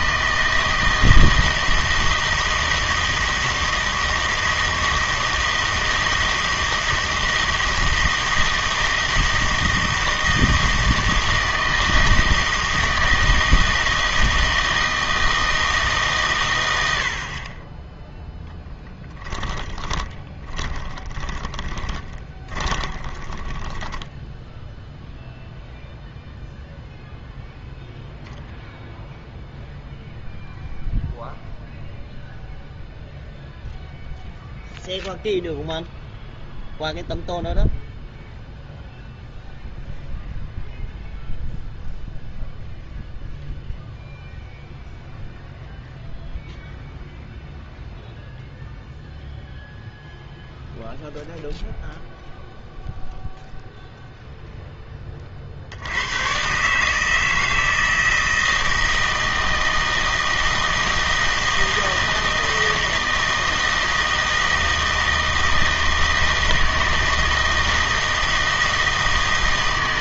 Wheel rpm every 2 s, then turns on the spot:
160, 160, 160, 160, 160, 160, 160, 160, 90, 10, 20, 20, 0, 0, 0, 0, 0, 0, 0, 0, 0, 0, 0, 0, 0, 0, 0, 10, 140, 160, 160, 160, 160, 160, 160.
18-24